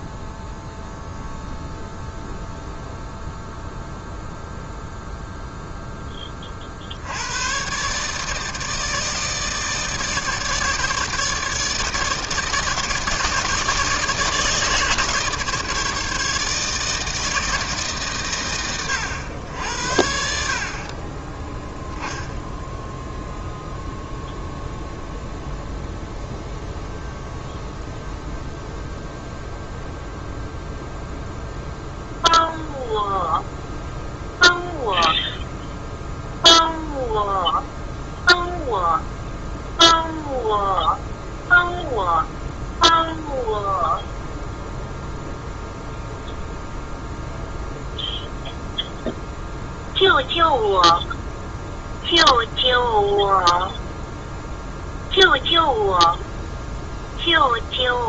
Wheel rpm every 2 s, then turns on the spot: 0, 0, 0, 50, 160, 150, 160, 150, 150, 110, 50, 0, 0, 0, 0, 0, 0, 0, 0, 0, 0, 0, 0, 0, 0, 0, 0, 0, 0.
none